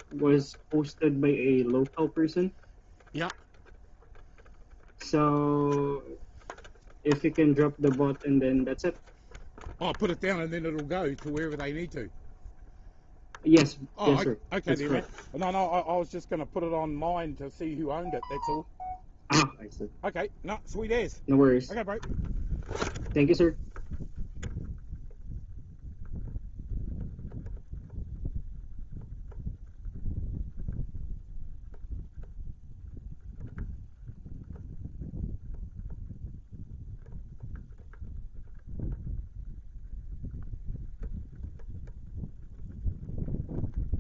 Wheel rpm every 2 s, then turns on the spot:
0, 0, 0, 0, 0, 0, 0, 0, 0, 0, 0, 0, 0, 0, 0, 0, 0, 0, 0, 0, 0, 0.
none